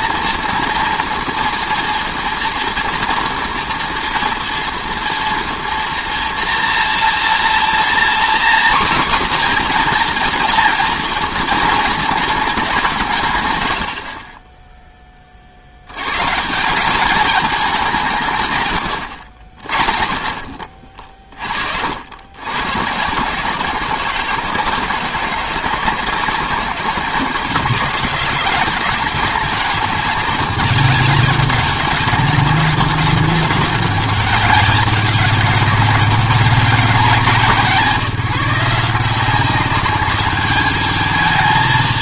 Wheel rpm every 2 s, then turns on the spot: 230, 230, 230, 240, 260, 230, 160, 10, 190, 110, 40, 120, 160, 150, 180, 200, 190, 190, 200, 170, 210.
none